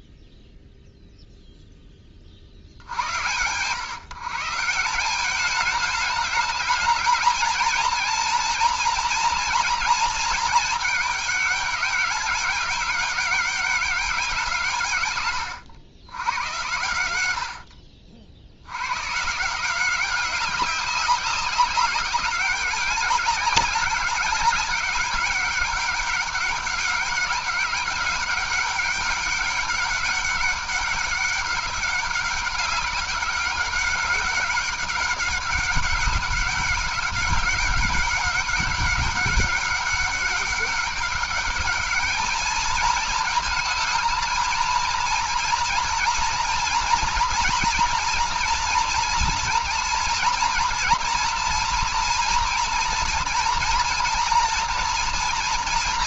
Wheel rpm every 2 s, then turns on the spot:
0, 70, 170, 220, 230, 220, 200, 150, 100, 80, 190, 190, 200, 200, 200, 200, 200, 190, 200, 200, 200, 210, 230, 230, 230, 230, 230, 230.
none